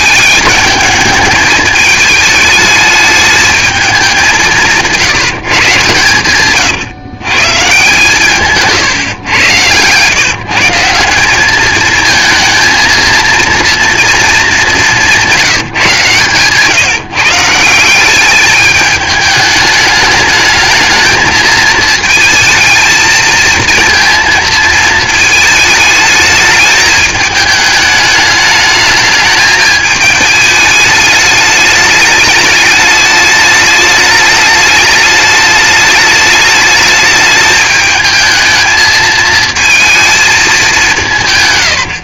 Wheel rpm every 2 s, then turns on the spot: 210, 210, 170, 130, 140, 150, 230, 210, 150, 210, 210, 220, 220, 210, 210, 210, 210, 210, 210, 220, 200.
none